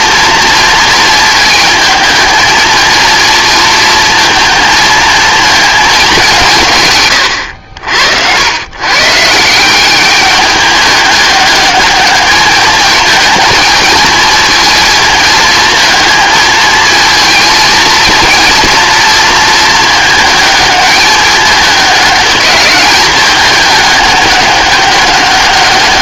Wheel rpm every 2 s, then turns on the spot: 230, 220, 220, 160, 110, 210, 210, 220, 220, 230, 220, 200, 200.
none